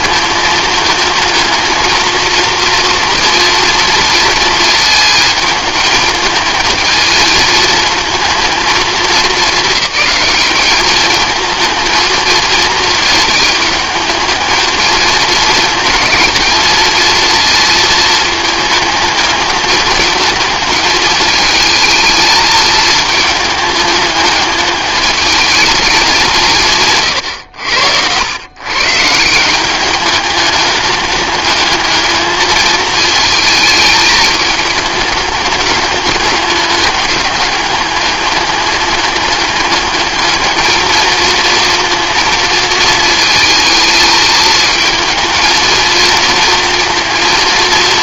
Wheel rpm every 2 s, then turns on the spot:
210, 230, 220, 220, 220, 210, 220, 220, 220, 220, 220, 220, 210, 190, 100, 200, 220, 220, 200, 210, 210, 230, 220, 230.
none